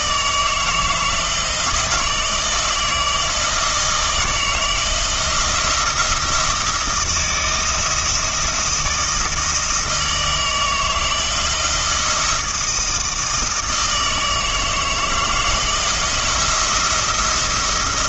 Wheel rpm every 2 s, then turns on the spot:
160, 160, 160, 170, 160, 160, 160, 160, 170.
none